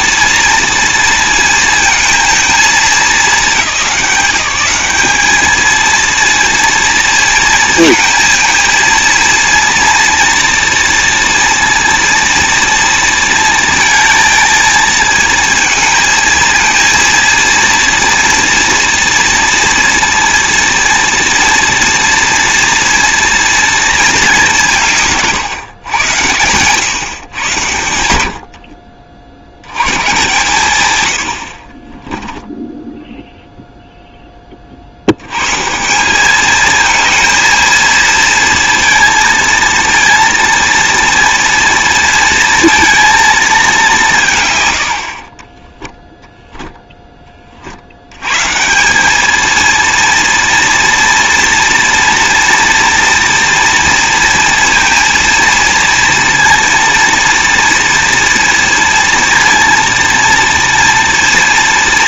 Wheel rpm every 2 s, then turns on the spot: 230, 220, 190, 230, 230, 230, 230, 230, 230, 230, 230, 230, 190, 110, 70, 120, 10, 40, 220, 230, 230, 230, 120, 10, 150, 230, 230, 230, 230, 230, 230.
28-30